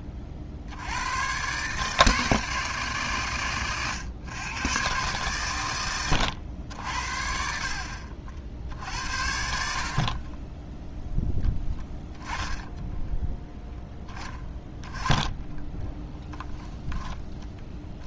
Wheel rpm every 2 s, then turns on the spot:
90, 150, 120, 70, 60, 10, 10, 10, 10.
16-18